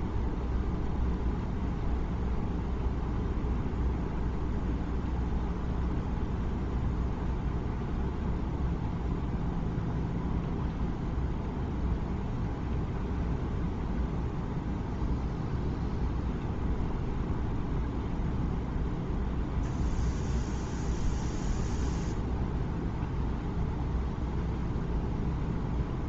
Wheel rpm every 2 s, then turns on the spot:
0, 0, 0, 0, 0, 0, 0, 0, 0, 0, 0, 0, 0.
none